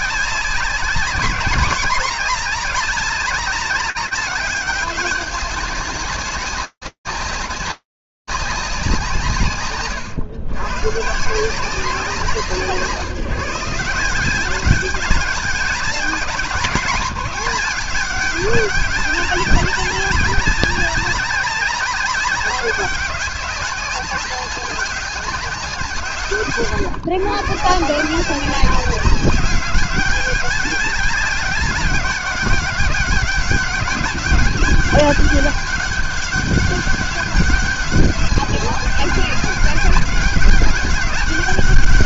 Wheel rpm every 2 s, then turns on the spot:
200, 200, 200, 200, 100, 170, 190, 200, 200, 200, 200, 200, 160, 170, 200, 200, 200, 200, 190, 200, 200.
none